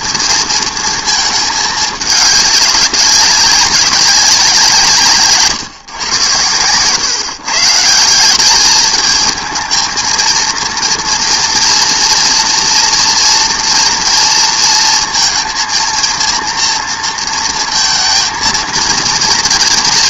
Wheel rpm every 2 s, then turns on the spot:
230, 200, 180, 110, 200, 230, 240, 230, 230, 230.
none